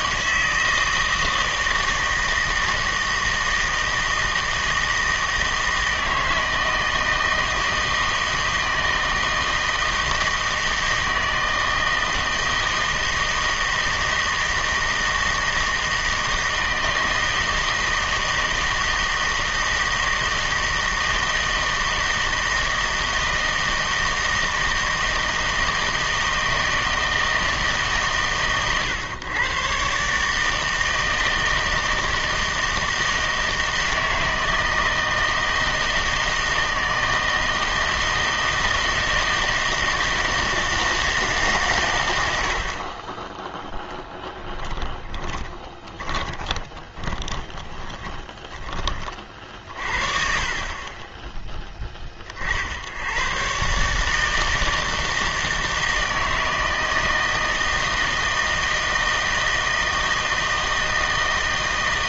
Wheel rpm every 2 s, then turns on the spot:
160, 160, 160, 160, 160, 160, 160, 160, 160, 160, 160, 160, 160, 160, 120, 160, 160, 160, 160, 160, 160, 60, 20, 20, 20, 40, 60, 160, 160, 160, 160.
44-48